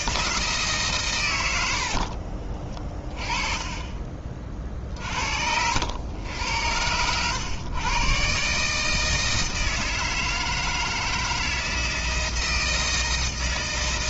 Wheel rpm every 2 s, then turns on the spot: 140, 40, 50, 100, 150, 160, 160.
none